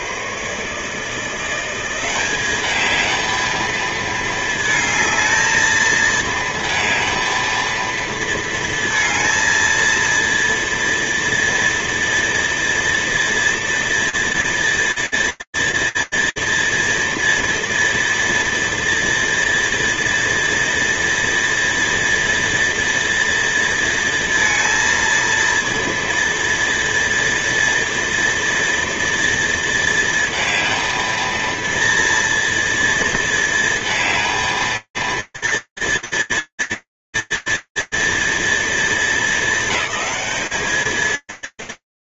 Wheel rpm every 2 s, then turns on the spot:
140, 210, 220, 220, 230, 230, 230, 230, 230, 230, 230, 230, 230, 230, 230, 230, 230, 230, 230, 230, 210.
none